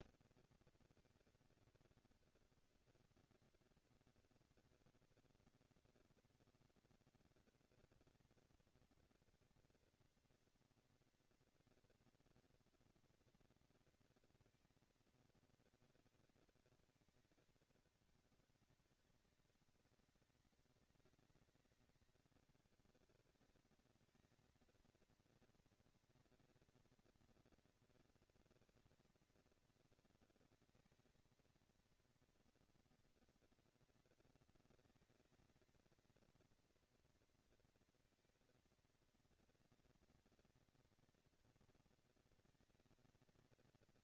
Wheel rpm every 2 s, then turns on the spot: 230, 230, 230, 240, 230, 230, 230, 230, 220, 200, 190, 210, 230, 230, 230, 230, 230, 230, 230, 230, 240, 230.
none